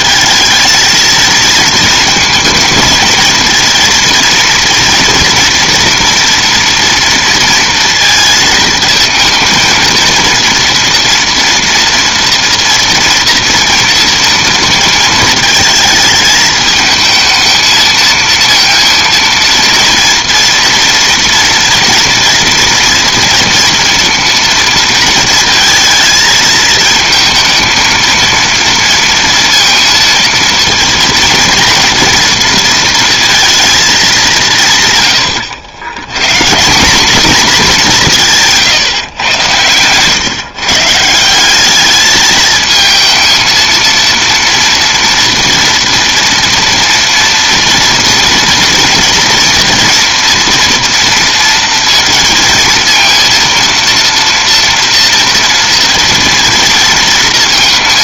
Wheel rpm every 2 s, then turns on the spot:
220, 220, 230, 230, 220, 230, 230, 230, 220, 230, 230, 240, 230, 220, 230, 230, 230, 170, 160, 150, 140, 220, 230, 230, 230, 240, 230, 230, 230.
none